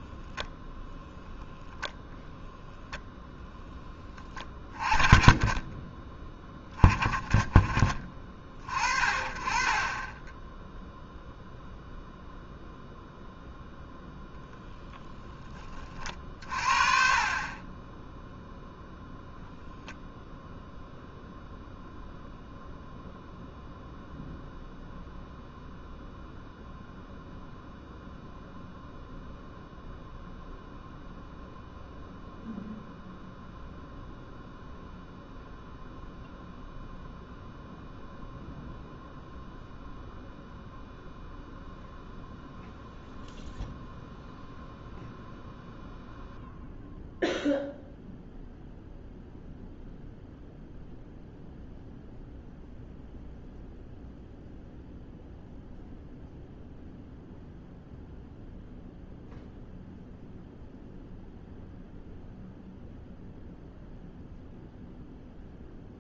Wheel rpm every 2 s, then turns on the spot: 0, 0, 30, 20, 40, 20, 0, 0, 40, 0, 0, 0, 0, 0, 0, 0, 0, 0, 0, 0, 0, 0, 0, 0, 0, 0, 0, 0, 0, 0, 0, 0, 0.
none